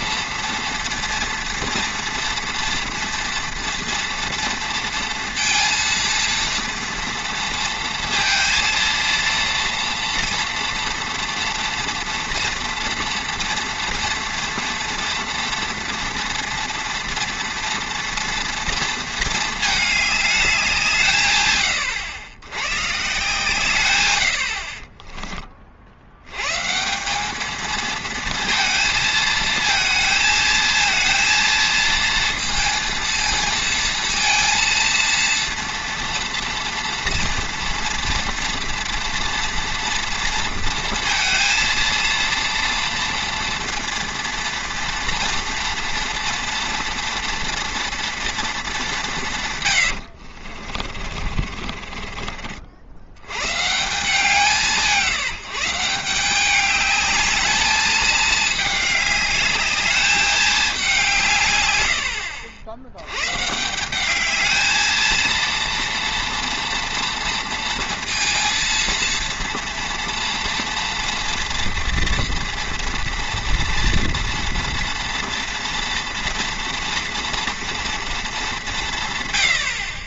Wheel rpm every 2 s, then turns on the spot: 230, 230, 230, 230, 230, 230, 240, 230, 230, 230, 180, 120, 50, 150, 230, 220, 230, 230, 230, 230, 230, 230, 230, 230, 200, 50, 70, 170, 200, 210, 200, 80, 220, 230, 230, 230, 230, 240, 230, 170.
50-52